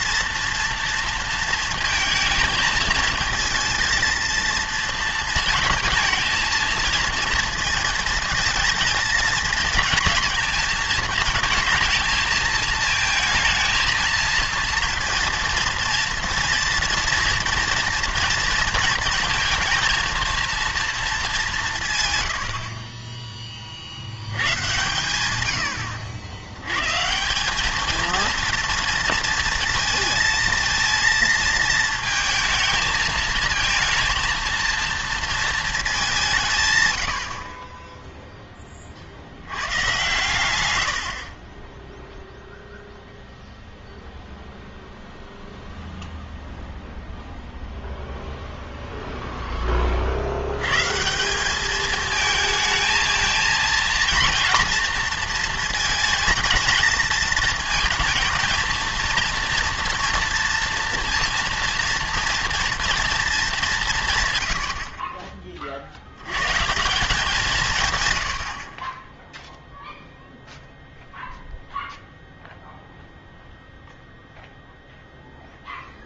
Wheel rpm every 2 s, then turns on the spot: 230, 220, 230, 230, 220, 230, 220, 230, 230, 230, 230, 50, 110, 110, 230, 230, 220, 230, 150, 20, 100, 0, 0, 0, 0, 130, 220, 240, 220, 230, 230, 230, 80, 140, 30, 0, 0, 0.
none